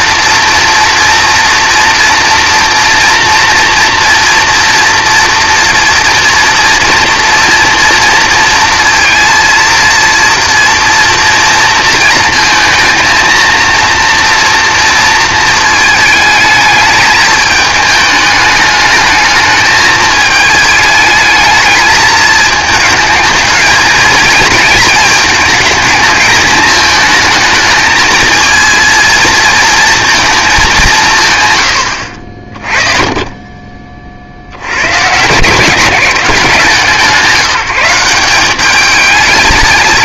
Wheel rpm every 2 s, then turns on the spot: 230, 230, 230, 230, 230, 230, 220, 230, 220, 210, 220, 220, 220, 220, 230, 210, 40, 70, 170, 200.
none